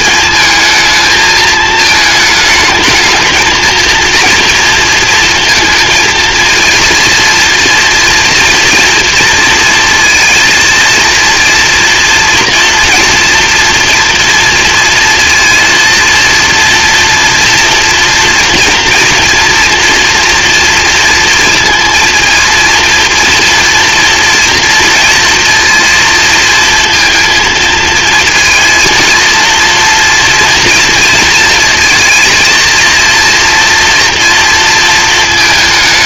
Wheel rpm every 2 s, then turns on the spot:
220, 220, 230, 230, 230, 230, 230, 230, 230, 230, 230, 230, 230, 230, 230, 230, 230, 230.
none